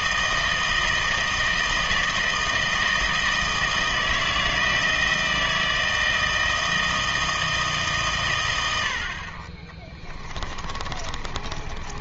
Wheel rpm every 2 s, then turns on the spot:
160, 160, 160, 160, 90, 30.
10-12